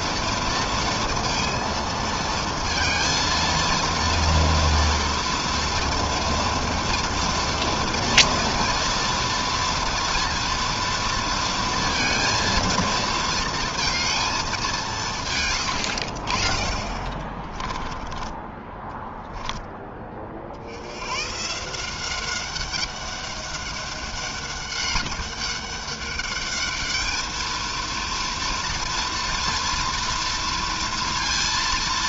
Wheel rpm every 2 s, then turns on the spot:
230, 230, 230, 240, 230, 230, 230, 140, 20, 10, 130, 200, 200, 220, 230, 230.
16-18